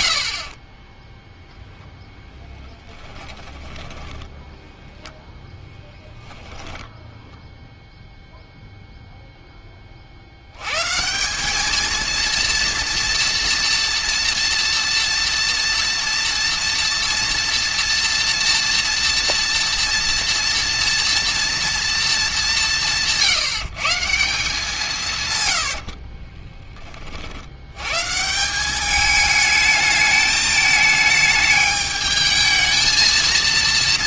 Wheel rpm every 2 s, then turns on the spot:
30, 10, 10, 10, 0, 110, 230, 240, 230, 230, 230, 190, 170, 20, 190, 220, 220.
0-4 6-8